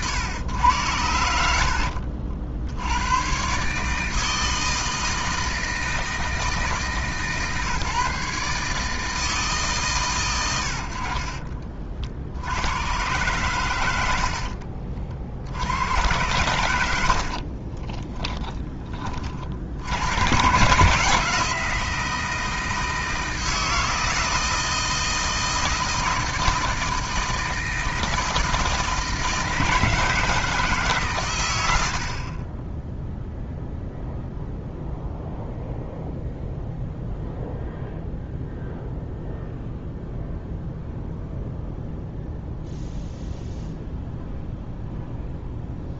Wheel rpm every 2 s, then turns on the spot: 100, 80, 160, 150, 150, 80, 100, 40, 100, 20, 130, 160, 160, 160, 160, 150, 10, 0, 0, 0, 0, 0, 0.
14-16